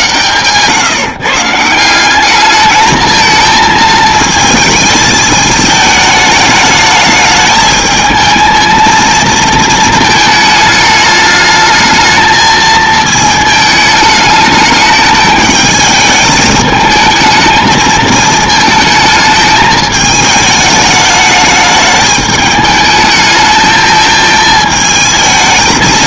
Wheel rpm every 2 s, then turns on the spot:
130, 220, 220, 210, 220, 220, 220, 210, 220, 220, 210, 210, 220.
none